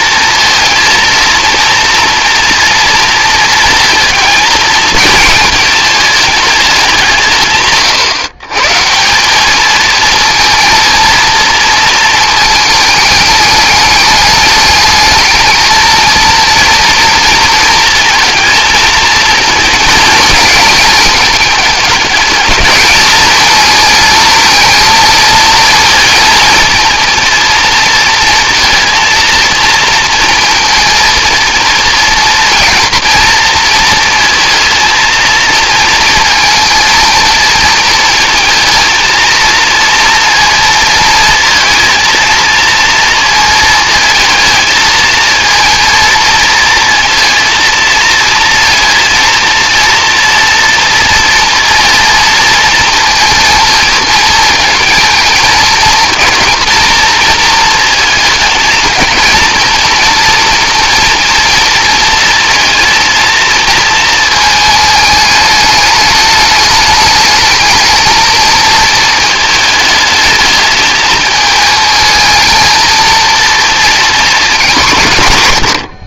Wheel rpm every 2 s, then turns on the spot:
230, 230, 220, 200, 140, 230, 220, 210, 230, 230, 220, 210, 230, 230, 230, 230, 230, 220, 230, 230, 230, 230, 230, 230, 230, 240, 230, 230, 230, 220, 230, 220, 220, 210, 230, 220, 230, 200.
none